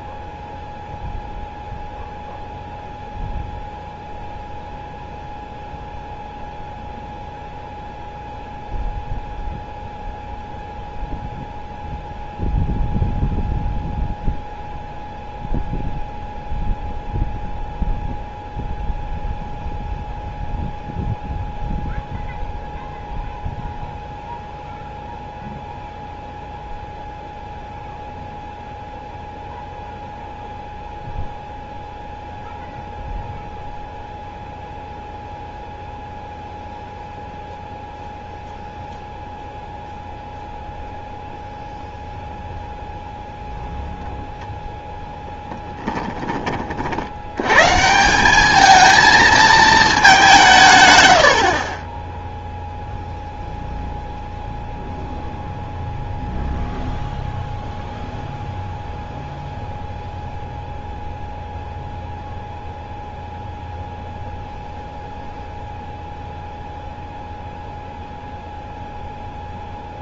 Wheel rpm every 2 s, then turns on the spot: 0, 0, 0, 0, 0, 0, 0, 0, 0, 0, 0, 0, 0, 0, 0, 0, 0, 0, 0, 0, 0, 0, 0, 50, 220, 130, 0, 0, 0, 0, 0, 0, 0, 0, 0.
none